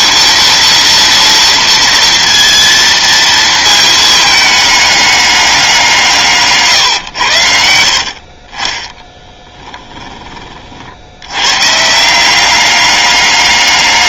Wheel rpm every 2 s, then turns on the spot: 230, 230, 210, 140, 30, 50, 190.
none